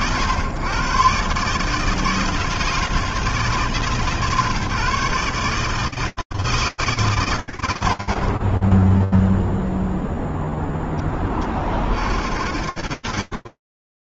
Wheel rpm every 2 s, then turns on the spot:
110, 160, 140, 150, 10, 20, 110.
none